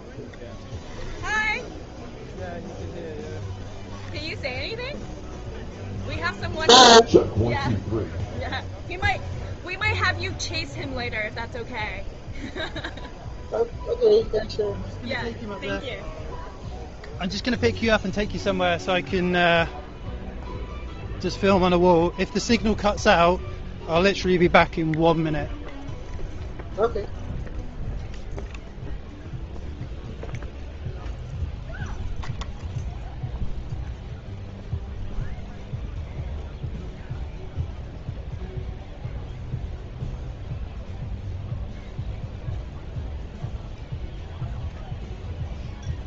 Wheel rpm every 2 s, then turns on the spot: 0, 0, 0, 0, 0, 0, 0, 0, 0, 0, 0, 0, 0, 0, 0, 0, 0, 0, 0, 0, 0, 0, 0.
none